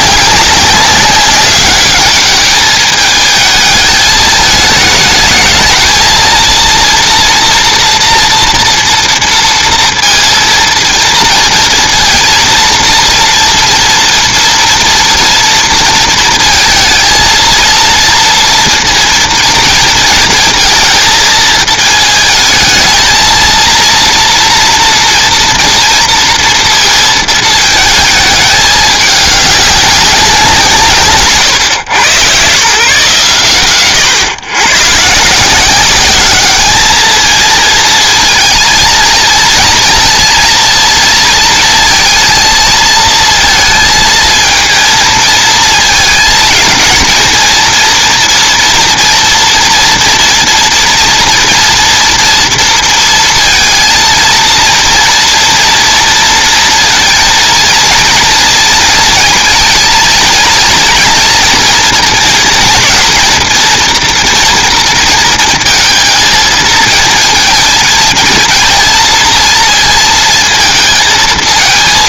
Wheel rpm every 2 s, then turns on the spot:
190, 210, 210, 230, 230, 230, 230, 230, 230, 230, 220, 220, 230, 230, 210, 160, 130, 120, 210, 230, 230, 230, 230, 230, 240, 230, 230, 230, 220, 230, 220, 230, 230, 220, 230, 230.
none